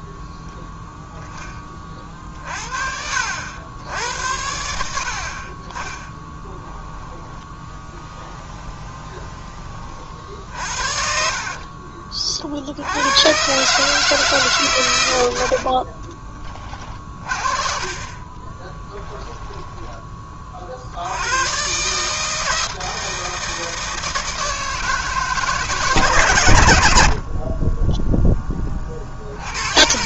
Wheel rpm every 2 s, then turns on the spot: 0, 60, 60, 10, 20, 50, 100, 110, 30, 10, 90, 160, 160, 60, 60.
6-8 10-12